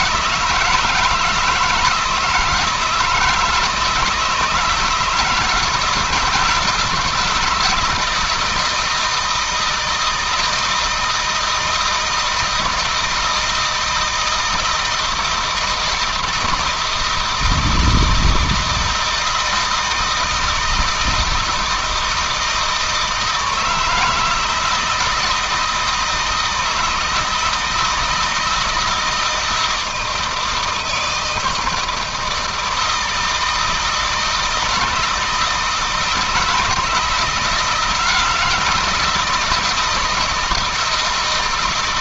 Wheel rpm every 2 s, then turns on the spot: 160, 160, 160, 160, 160, 160, 160, 160, 170, 160, 170, 160, 160, 160, 160, 160, 160, 160, 160, 170, 160.
none